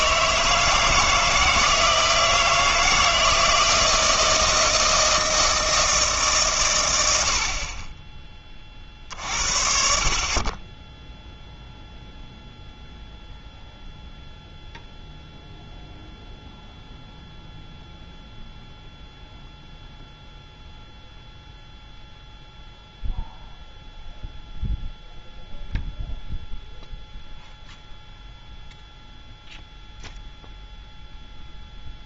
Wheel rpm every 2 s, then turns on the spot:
160, 160, 160, 120, 40, 10, 0, 0, 0, 0, 0, 0, 0, 0, 0, 0.
none